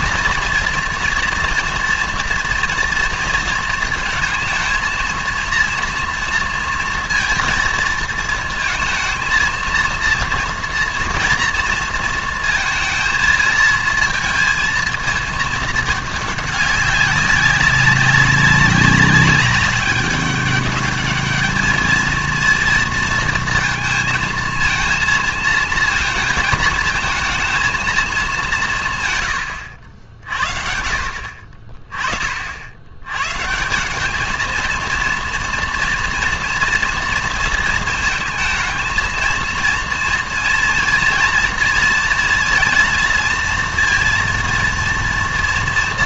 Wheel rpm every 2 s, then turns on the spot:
230, 230, 230, 230, 230, 230, 230, 220, 200, 190, 210, 230, 220, 220, 150, 60, 70, 230, 240, 230, 230, 230, 230.
none